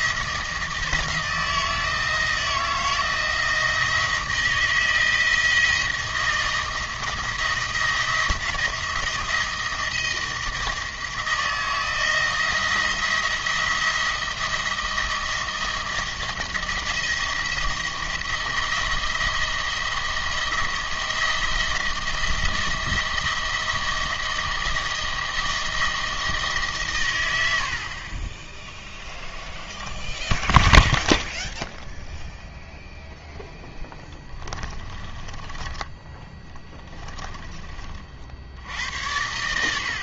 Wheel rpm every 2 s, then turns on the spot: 160, 160, 160, 170, 160, 160, 160, 170, 170, 170, 170, 170, 170, 140, 10, 0, 0, 20, 10, 70.
28-30 34-38